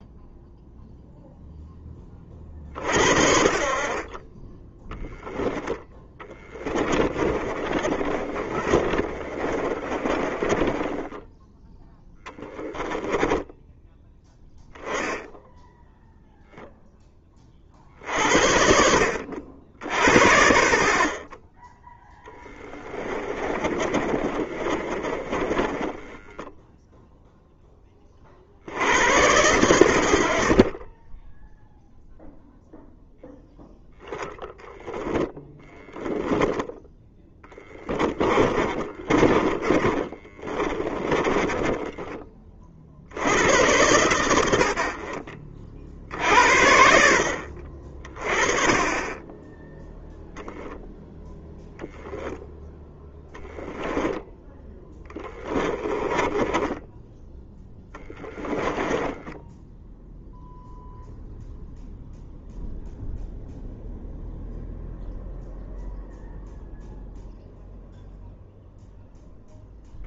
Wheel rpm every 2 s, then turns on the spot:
0, 50, 10, 20, 30, 20, 10, 0, 10, 70, 60, 30, 30, 0, 100, 30, 0, 10, 20, 30, 20, 60, 70, 70, 30, 0, 10, 10, 10, 10, 0, 0, 0, 0, 0.
6-14 22-26 36-42 54-56 58-60